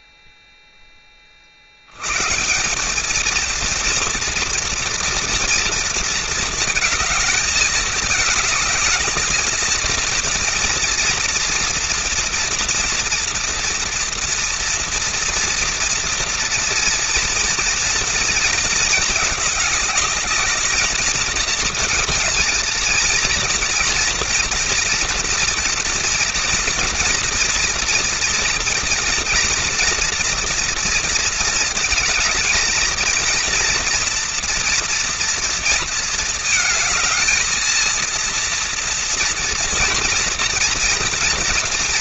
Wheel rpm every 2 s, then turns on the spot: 20, 220, 240, 220, 220, 240, 230, 230, 230, 220, 230, 230, 230, 230, 230, 230, 220, 230, 220, 230, 240.
none